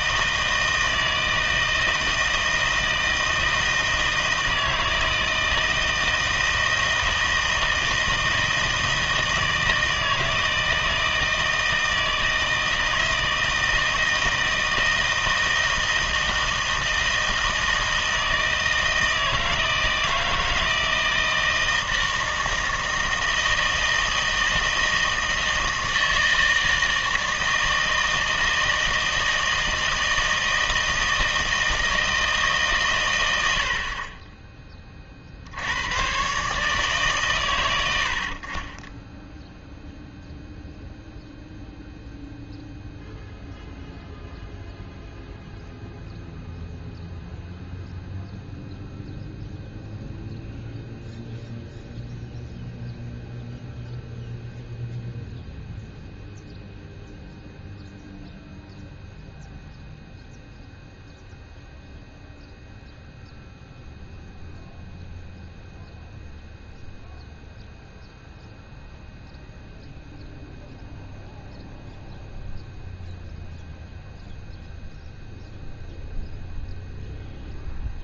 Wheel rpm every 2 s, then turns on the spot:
160, 160, 160, 160, 160, 160, 160, 160, 160, 160, 160, 160, 160, 160, 160, 160, 140, 20, 150, 30, 0, 0, 0, 0, 0, 0, 0, 0, 0, 0, 0, 0, 0, 0, 0, 0, 0, 0, 0.
none